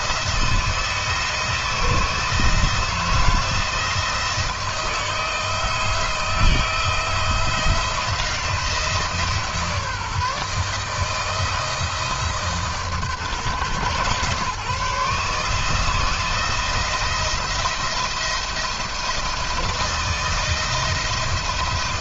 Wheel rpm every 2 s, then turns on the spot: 160, 170, 160, 170, 160, 160, 150, 140, 170, 160, 160.
none